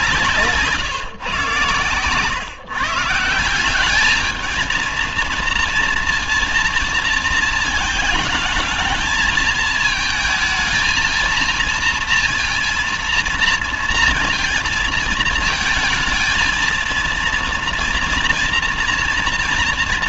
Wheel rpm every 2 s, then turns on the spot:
160, 130, 220, 230, 210, 220, 230, 230, 220, 230.
none